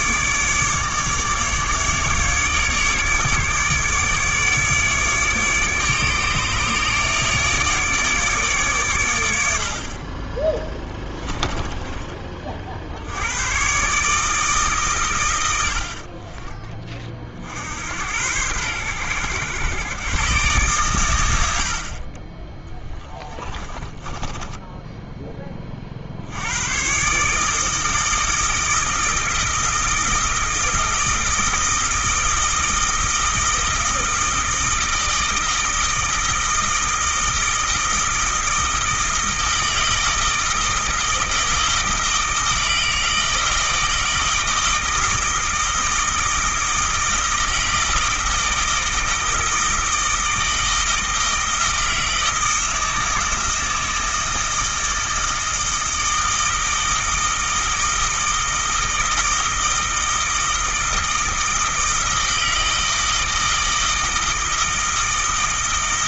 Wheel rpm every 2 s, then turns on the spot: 150, 150, 150, 150, 120, 10, 60, 130, 30, 100, 120, 10, 10, 120, 160, 160, 160, 160, 160, 160, 160, 160, 160, 160, 160, 160, 160, 160, 160, 160, 160, 160, 160.
10-12 22-26